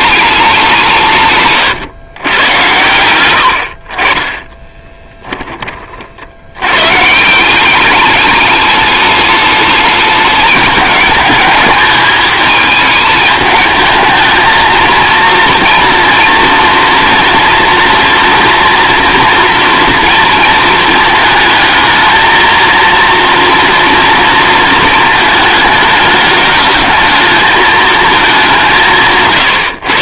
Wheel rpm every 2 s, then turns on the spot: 180, 110, 10, 110, 210, 210, 220, 230, 230, 240, 220, 230, 220, 210, 170.
4-6